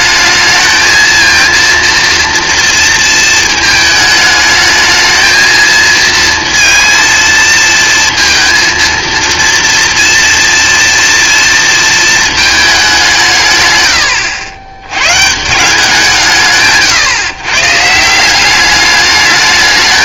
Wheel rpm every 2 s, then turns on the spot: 220, 230, 220, 230, 230, 240, 190, 120, 150, 200.
none